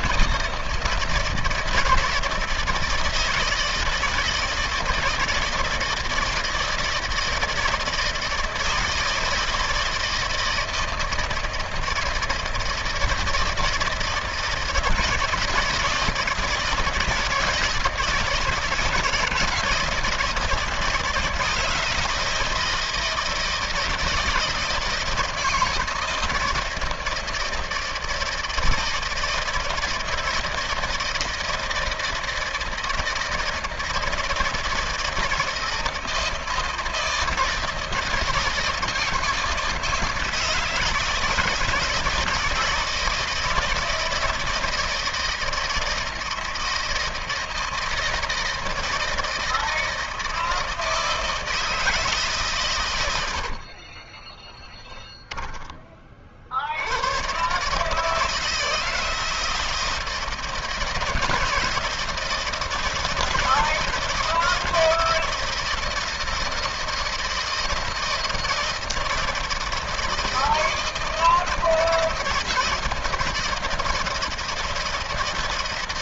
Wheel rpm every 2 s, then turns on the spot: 160, 160, 170, 160, 160, 160, 160, 160, 160, 160, 160, 160, 160, 160, 160, 160, 160, 160, 160, 160, 170, 160, 160, 160, 160, 160, 140, 10, 60, 160, 160, 160, 160, 160, 160, 160, 160, 160.
54-56